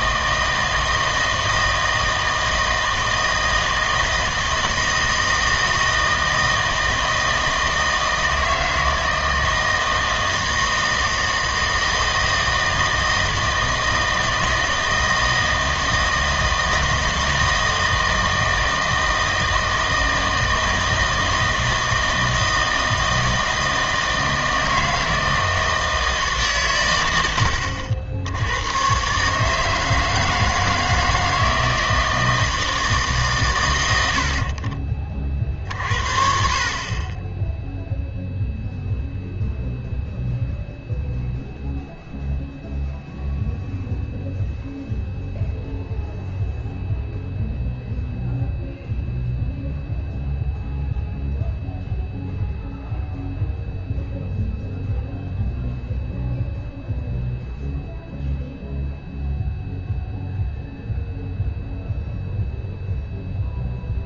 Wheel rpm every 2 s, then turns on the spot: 160, 160, 160, 160, 160, 160, 160, 160, 160, 160, 160, 160, 160, 130, 100, 160, 160, 50, 50, 0, 0, 0, 0, 0, 0, 0, 0, 0, 0, 0, 0, 0.
none